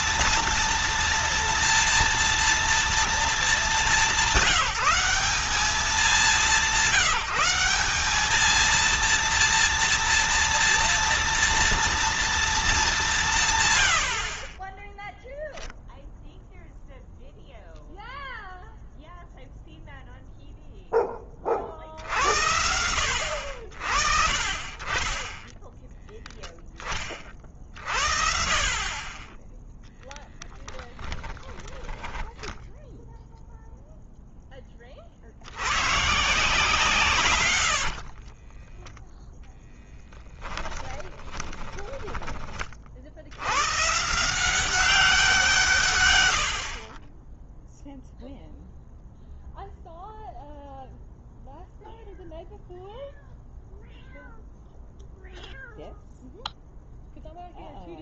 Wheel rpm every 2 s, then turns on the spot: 230, 230, 190, 180, 230, 230, 210, 20, 0, 0, 0, 80, 20, 20, 40, 20, 10, 30, 150, 10, 10, 50, 190, 50, 0, 0, 0, 0, 0.
30-32 38-42